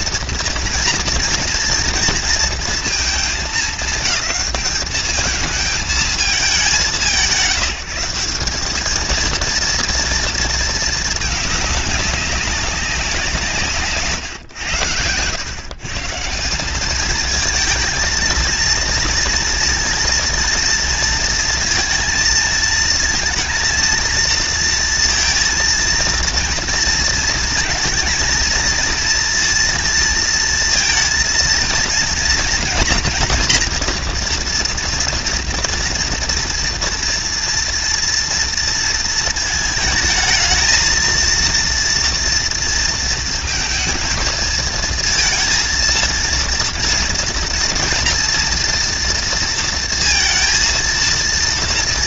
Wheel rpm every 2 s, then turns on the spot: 230, 230, 220, 190, 200, 230, 200, 110, 190, 230, 230, 220, 230, 230, 230, 230, 230, 240, 230, 230, 220, 230, 230, 230, 230, 230.
none